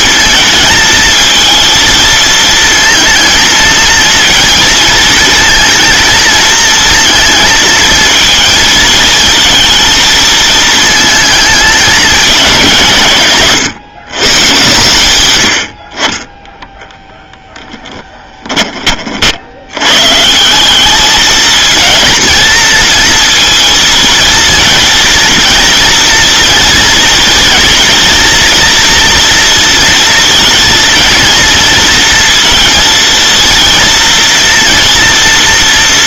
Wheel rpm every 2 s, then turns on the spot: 220, 230, 230, 230, 220, 220, 180, 110, 10, 30, 190, 230, 230, 230, 230, 230, 230, 230.
none